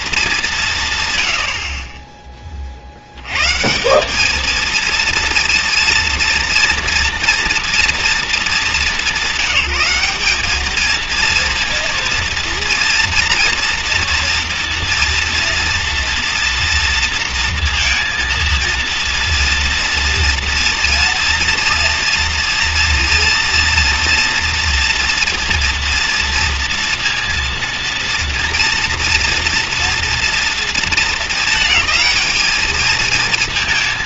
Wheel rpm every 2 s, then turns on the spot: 200, 20, 210, 230, 210, 210, 230, 230, 230, 230, 230, 230, 230, 230, 230, 240, 220.
none